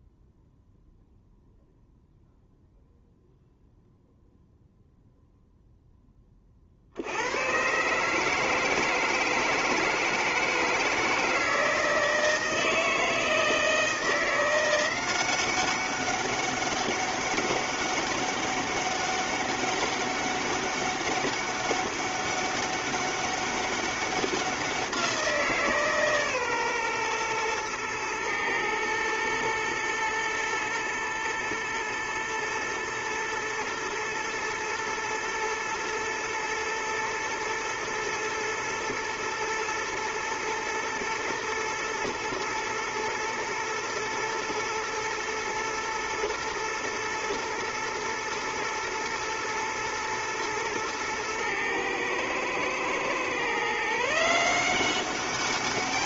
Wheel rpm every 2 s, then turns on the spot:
0, 0, 0, 30, 160, 160, 160, 170, 200, 200, 200, 200, 190, 130, 110, 120, 110, 120, 120, 120, 120, 120, 110, 120, 110, 110, 110, 170.
none